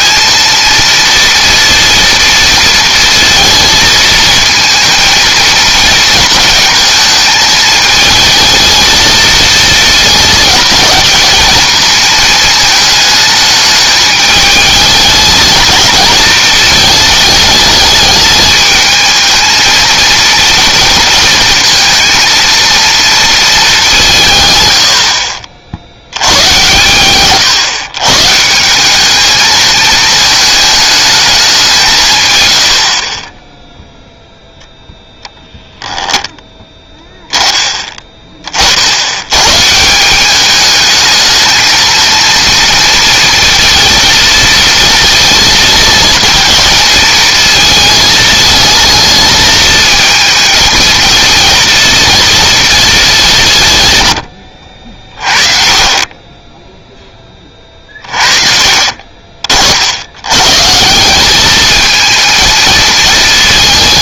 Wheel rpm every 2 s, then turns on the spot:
230, 230, 220, 220, 220, 220, 220, 220, 220, 220, 240, 230, 110, 110, 180, 220, 70, 0, 10, 60, 210, 230, 230, 220, 220, 220, 210, 50, 10, 40, 140, 220.
54-56 58-60